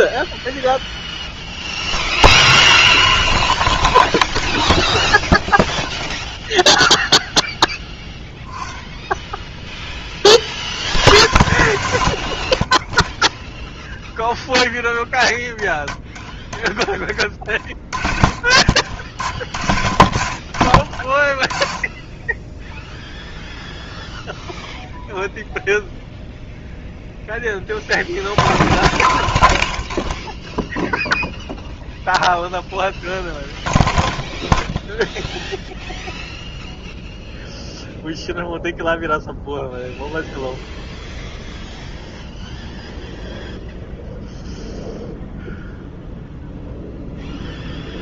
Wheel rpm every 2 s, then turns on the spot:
10, 10, 30, 0, 10, 70, 20, 10, 10, 50, 50, 0, 0, 0, 0, 0, 0, 0, 0, 0, 0, 0, 0, 0.
12-14 18-20